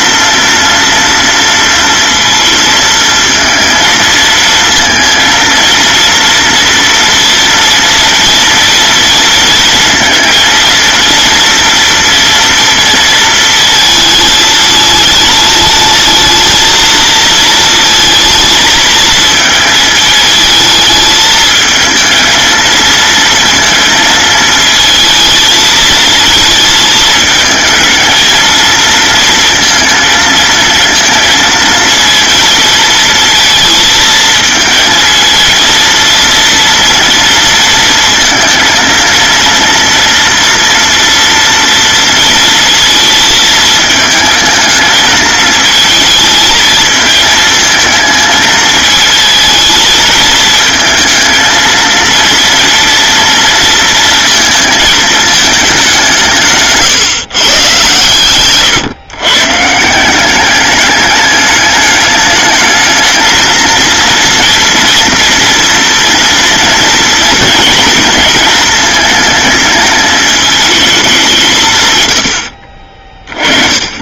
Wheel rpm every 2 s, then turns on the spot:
230, 220, 230, 230, 230, 230, 230, 210, 220, 230, 220, 220, 220, 220, 230, 230, 230, 220, 230, 220, 230, 230, 220, 220, 220, 220, 230, 220, 140, 130, 200, 210, 230, 230, 220, 220, 50.
56-58